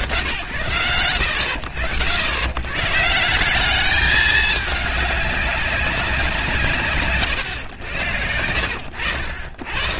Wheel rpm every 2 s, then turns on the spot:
100, 90, 200, 130, 90.
none